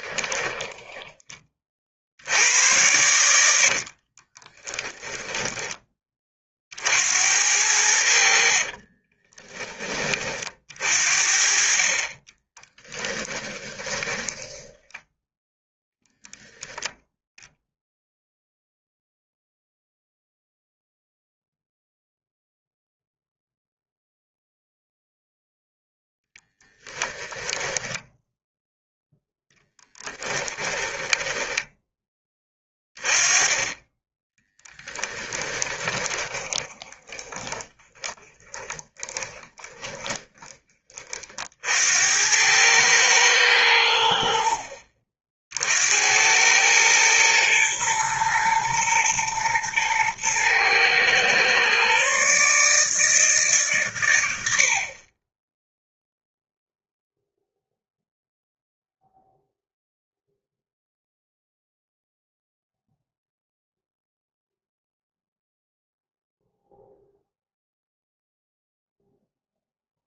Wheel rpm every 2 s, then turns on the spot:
20, 100, 20, 50, 50, 50, 10, 10, 0, 0, 0, 0, 0, 10, 0, 10, 20, 10, 20, 30, 20, 100, 60, 100, 110, 120, 150, 60, 0, 0, 0, 0, 0, 0, 0.
0-2 4-6 8-10 12-16 26-28 30-32 34-40